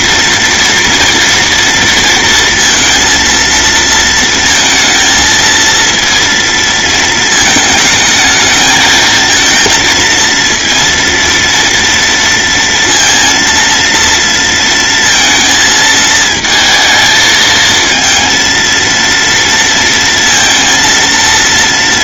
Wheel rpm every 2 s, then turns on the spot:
230, 230, 230, 230, 220, 230, 230, 230, 220, 230, 230.
none